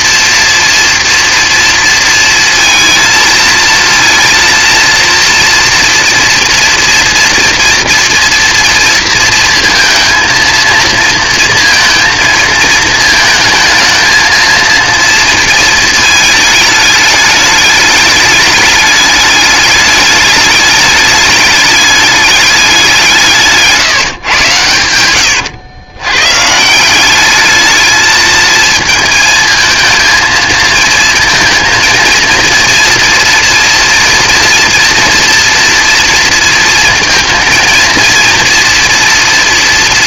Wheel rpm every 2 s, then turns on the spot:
230, 230, 230, 230, 230, 220, 230, 230, 220, 210, 210, 210, 140, 130, 220, 220, 230, 230, 230, 230.
none